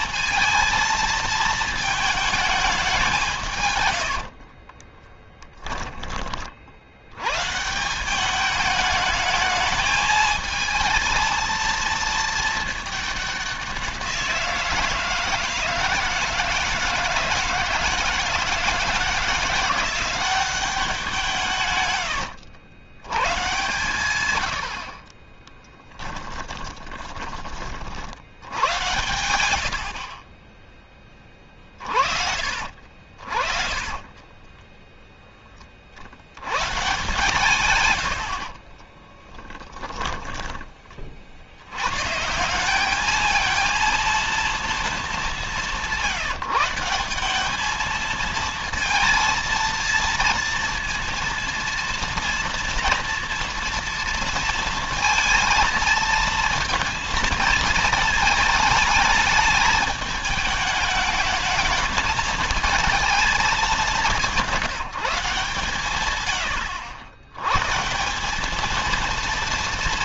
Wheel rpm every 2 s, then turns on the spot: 220, 200, 30, 90, 210, 230, 210, 170, 160, 160, 180, 100, 50, 20, 100, 20, 50, 10, 130, 20, 30, 200, 220, 180, 230, 230, 230, 230, 230, 220, 220, 220, 170, 100, 230.
4-6 26-36 38-40